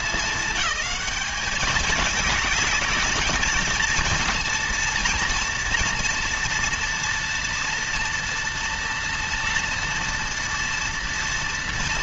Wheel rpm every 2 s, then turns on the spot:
200, 210, 230, 230, 230, 230.
none